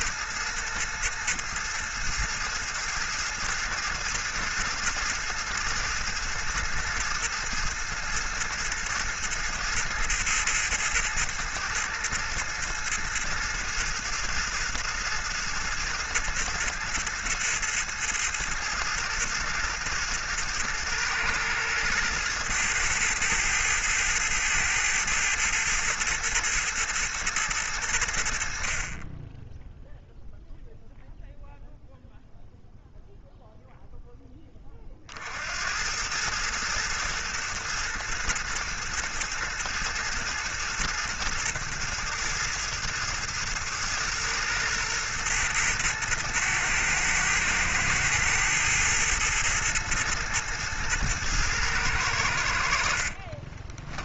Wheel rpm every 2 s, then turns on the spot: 110, 110, 110, 110, 110, 110, 110, 110, 110, 110, 110, 110, 110, 120, 50, 0, 0, 20, 110, 110, 110, 110, 110, 110, 110, 110, 70.
none